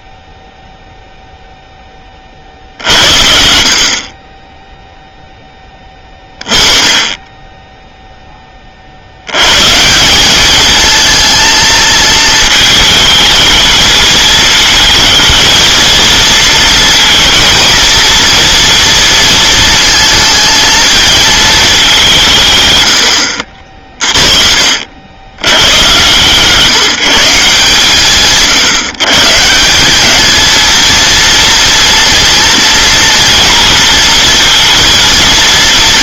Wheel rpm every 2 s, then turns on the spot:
10, 60, 20, 0, 170, 220, 220, 230, 230, 220, 190, 40, 130, 140, 200, 230, 230, 230.
none